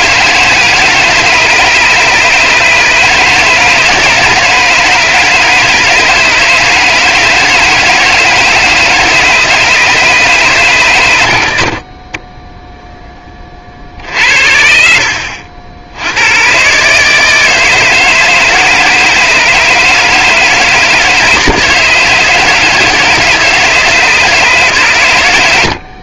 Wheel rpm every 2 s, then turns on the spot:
160, 150, 160, 150, 160, 120, 0, 70, 120, 160, 160, 160, 140.
none